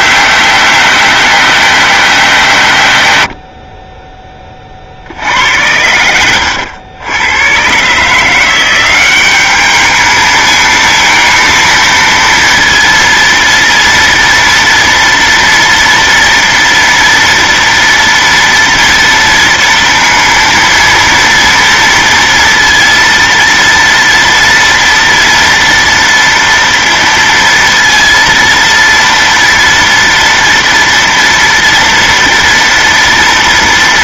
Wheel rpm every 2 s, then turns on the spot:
190, 140, 20, 100, 170, 220, 230, 230, 230, 230, 230, 230, 230, 230, 230, 240, 240.
none